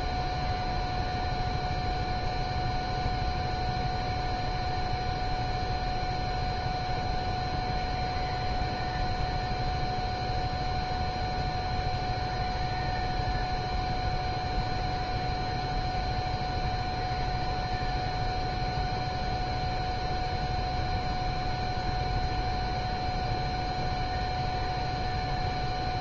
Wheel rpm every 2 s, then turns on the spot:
0, 0, 0, 0, 0, 0, 0, 0, 0, 0, 0, 0, 0.
none